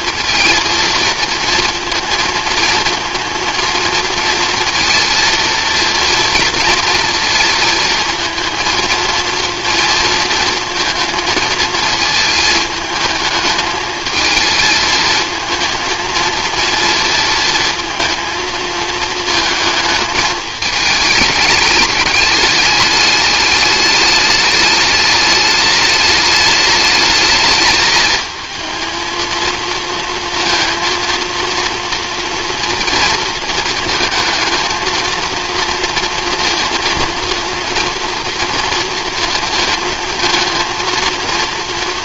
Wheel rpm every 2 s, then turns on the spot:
230, 230, 230, 230, 230, 230, 220, 220, 230, 220, 220, 210, 210, 210, 230, 230, 230, 220, 230, 230, 230.
none